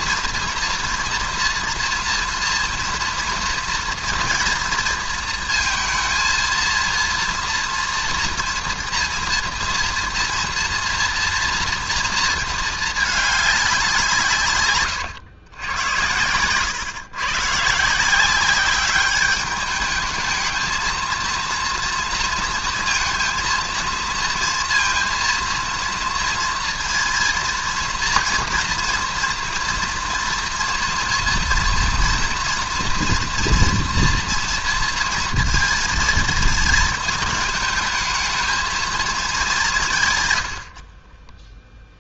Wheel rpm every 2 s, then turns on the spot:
230, 230, 230, 220, 230, 230, 220, 140, 100, 190, 220, 230, 230, 230, 230, 230, 230, 230, 230, 220, 100.
none